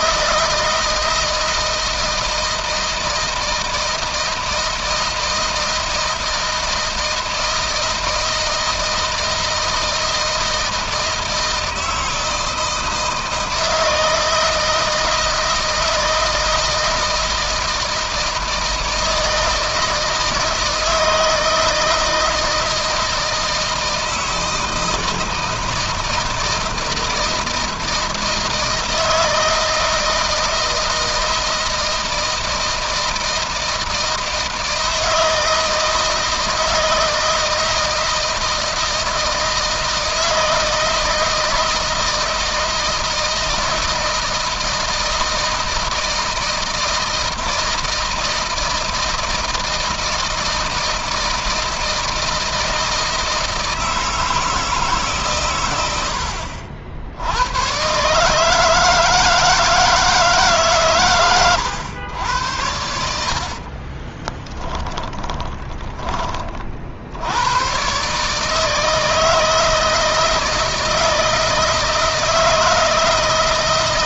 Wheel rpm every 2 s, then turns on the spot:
160, 160, 160, 160, 160, 160, 160, 160, 160, 160, 160, 160, 160, 160, 160, 160, 160, 160, 160, 160, 160, 160, 160, 160, 160, 160, 160, 140, 60, 160, 130, 80, 10, 70, 160, 160, 160.
64-66